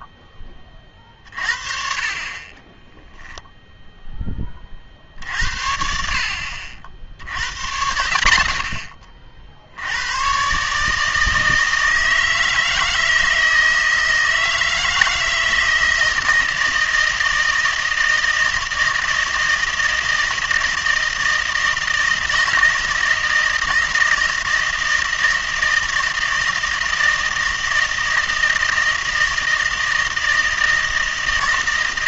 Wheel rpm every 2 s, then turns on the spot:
20, 20, 30, 60, 70, 140, 160, 160, 160, 160, 160, 160, 160, 160, 160, 160.
2-4